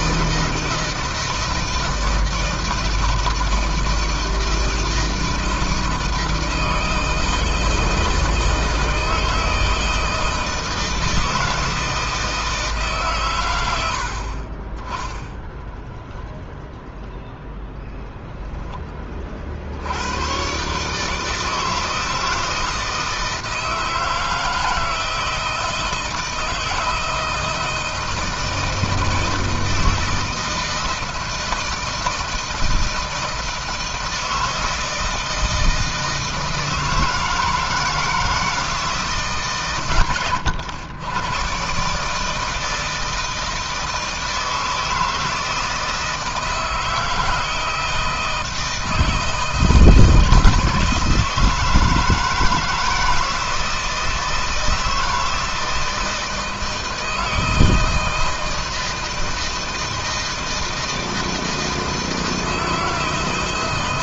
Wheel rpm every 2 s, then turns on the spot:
160, 160, 160, 160, 160, 160, 160, 30, 0, 10, 130, 160, 160, 160, 160, 160, 160, 160, 160, 160, 100, 160, 160, 160, 160, 160, 160, 160, 160, 160, 160, 160.
none